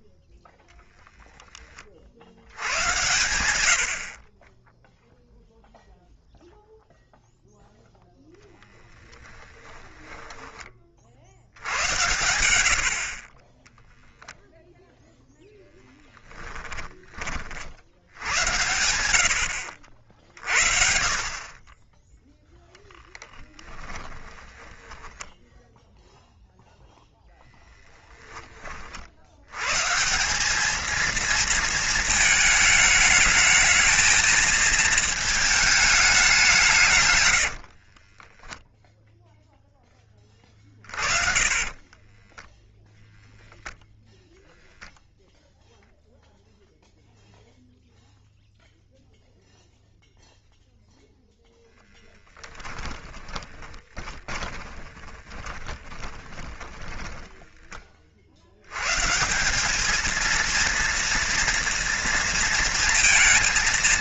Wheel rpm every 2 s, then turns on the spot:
0, 90, 10, 0, 10, 40, 60, 0, 20, 90, 50, 10, 10, 0, 40, 210, 210, 220, 150, 0, 40, 0, 0, 0, 0, 0, 20, 20, 30, 120, 230, 230.
16-18 24-26 40-42 52-58